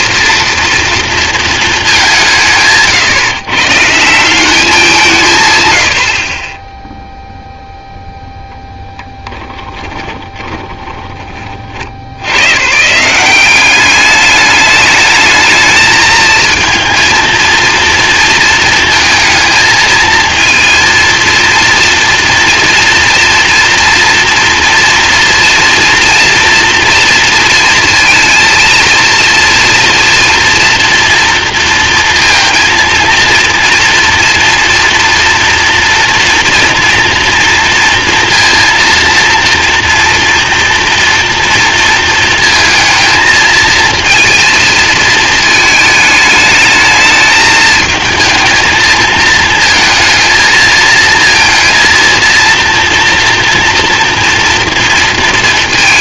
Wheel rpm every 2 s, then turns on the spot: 230, 150, 190, 20, 0, 20, 120, 210, 230, 230, 230, 230, 240, 240, 230, 230, 230, 230, 230, 230, 230, 220, 230, 220, 220, 220, 230, 230.
10-12